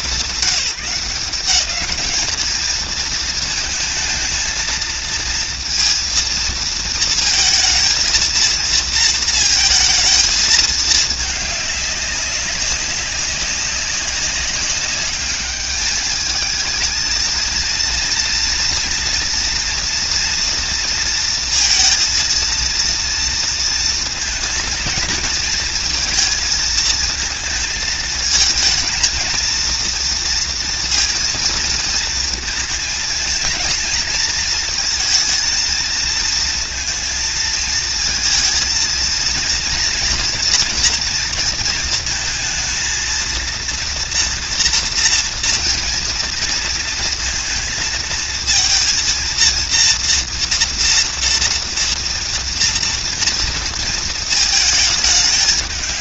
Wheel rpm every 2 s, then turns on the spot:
180, 220, 230, 230, 230, 220, 190, 200, 230, 230, 230, 230, 230, 230, 230, 230, 230, 230, 230, 230, 230, 230, 240, 230, 230, 230, 230, 220.
none